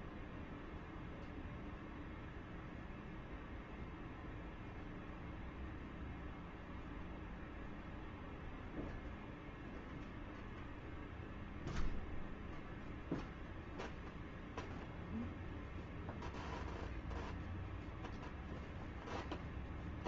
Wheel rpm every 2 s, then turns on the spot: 0, 0, 0, 0, 0, 0, 0, 0, 0, 0.
none